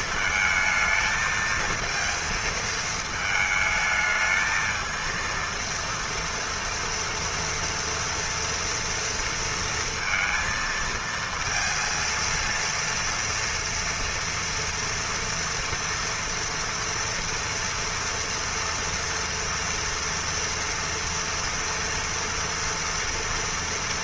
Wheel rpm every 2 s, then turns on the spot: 220, 220, 220, 230, 230, 230, 230, 230, 230, 240, 230, 230.
none